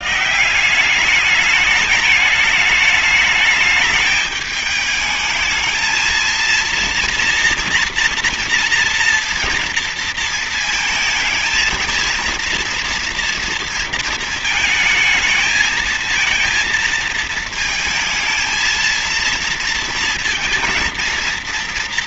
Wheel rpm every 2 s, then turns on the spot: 170, 210, 210, 230, 230, 220, 230, 220, 220, 220, 230.
none